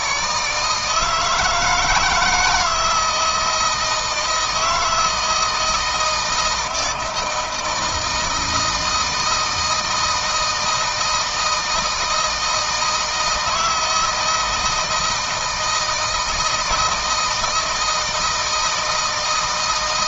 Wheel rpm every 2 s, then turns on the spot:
150, 160, 170, 160, 160, 160, 160, 160, 160, 160.
none